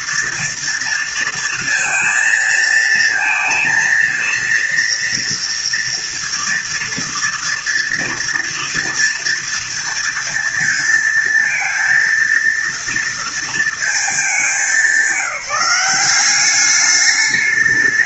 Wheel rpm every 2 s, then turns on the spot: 230, 230, 230, 230, 230, 230, 230, 190, 200.
none